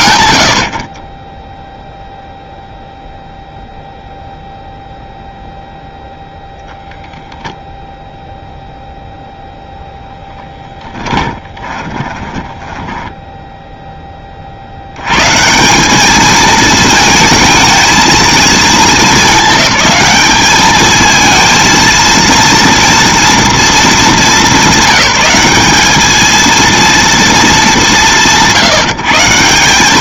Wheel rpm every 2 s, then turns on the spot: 0, 0, 0, 0, 0, 10, 10, 120, 220, 210, 220, 230, 190, 230, 160.
10-14